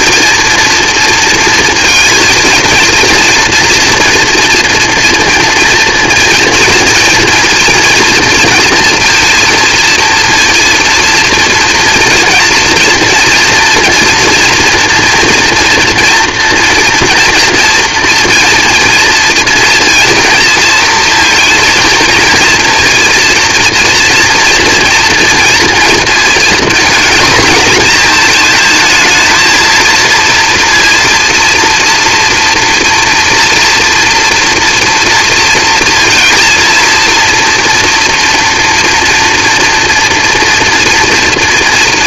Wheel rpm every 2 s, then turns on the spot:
230, 230, 240, 230, 230, 230, 230, 240, 240, 230, 230, 230, 230, 230, 220, 240, 240, 230, 230, 230, 230.
none